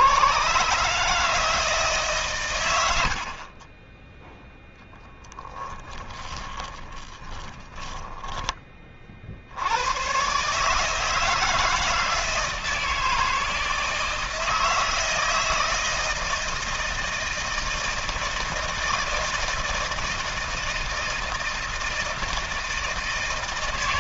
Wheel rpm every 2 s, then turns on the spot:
150, 80, 10, 30, 40, 160, 160, 160, 160, 160, 160, 160.
6-8